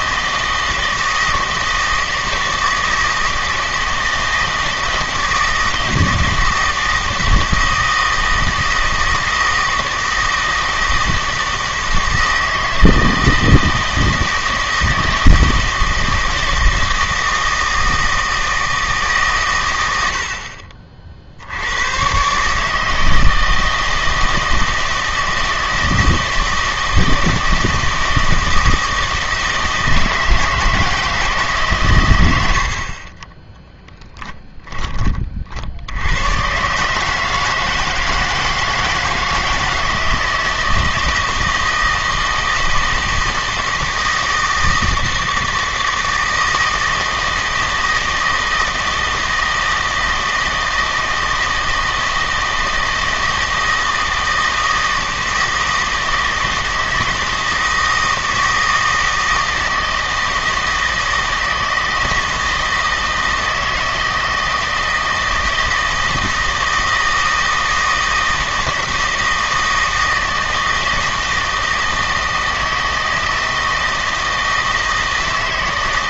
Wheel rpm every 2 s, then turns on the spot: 160, 160, 160, 160, 160, 160, 160, 160, 160, 160, 40, 150, 160, 160, 160, 160, 80, 20, 140, 160, 160, 160, 160, 160, 160, 160, 160, 160, 160, 160, 160, 160, 160, 160, 160, 160, 160, 160.
32-34